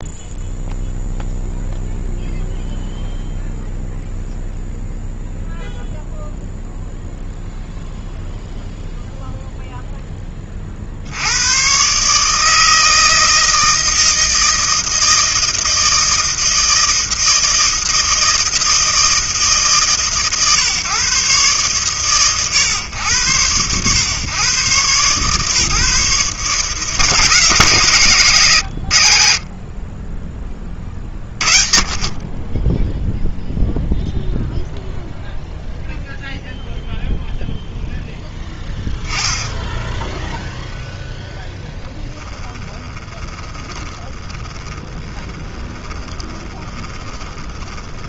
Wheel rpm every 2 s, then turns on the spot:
0, 0, 0, 0, 0, 30, 160, 160, 160, 160, 130, 120, 120, 150, 120, 30, 20, 0, 0, 0, 0, 20, 20, 20.
42-48